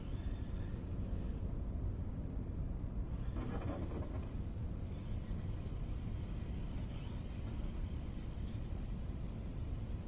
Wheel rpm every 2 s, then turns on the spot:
0, 0, 0, 0, 0.
none